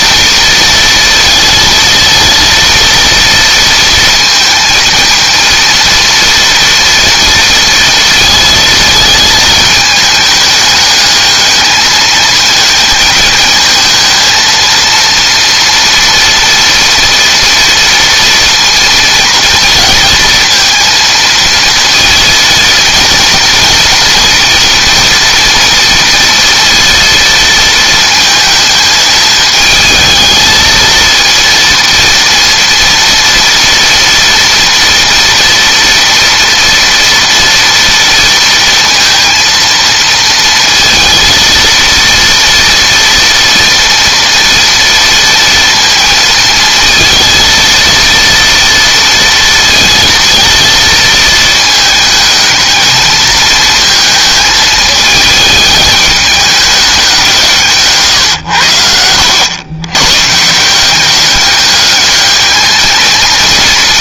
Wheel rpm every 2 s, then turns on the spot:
230, 230, 230, 230, 230, 210, 220, 230, 230, 230, 230, 230, 230, 230, 220, 220, 230, 240, 230, 230, 230, 230, 230, 230, 230, 230, 220, 220, 200, 80, 170, 220.
none